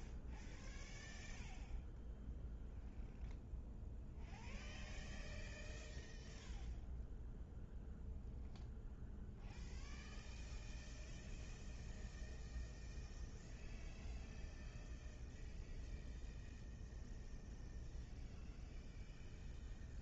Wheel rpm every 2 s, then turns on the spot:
0, 0, 0, 0, 0, 0, 0, 0, 0, 0.
none